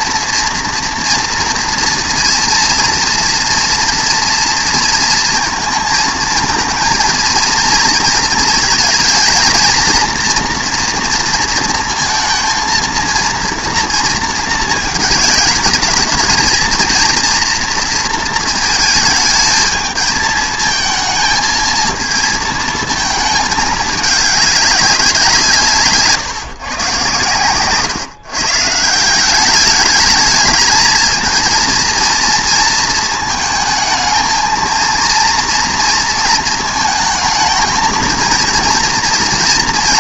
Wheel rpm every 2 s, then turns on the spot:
230, 230, 230, 230, 220, 240, 230, 220, 230, 220, 220, 220, 200, 130, 160, 220, 220, 230, 220, 230.
none